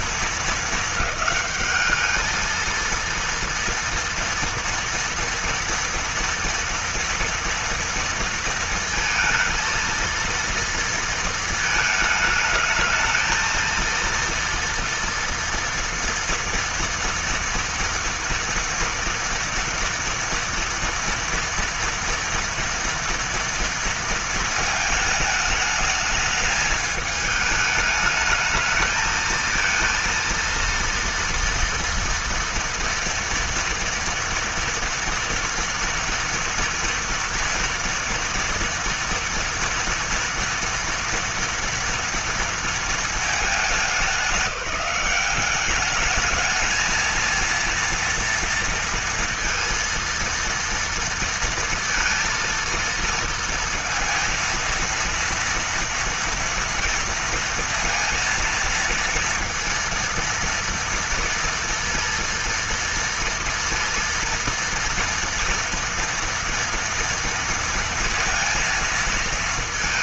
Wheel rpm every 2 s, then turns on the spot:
220, 220, 230, 230, 230, 230, 220, 230, 230, 230, 230, 230, 230, 210, 220, 230, 230, 240, 230, 230, 230, 230, 200, 220, 230, 230, 230, 230, 230, 230, 230, 230, 230, 230, 230.
none